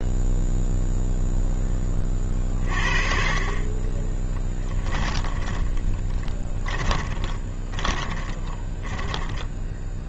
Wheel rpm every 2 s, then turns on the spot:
0, 40, 20, 10, 10.
4-10